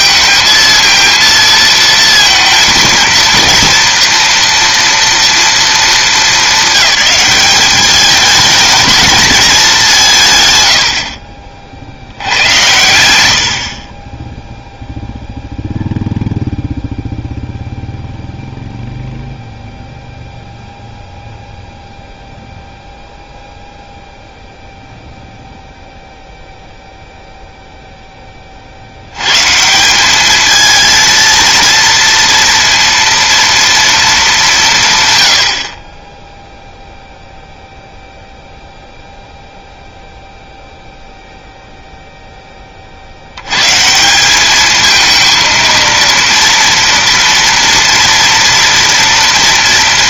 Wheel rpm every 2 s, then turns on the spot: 230, 230, 230, 200, 220, 100, 90, 0, 0, 0, 0, 0, 0, 0, 60, 220, 230, 170, 0, 0, 0, 30, 210, 230, 230.
10-12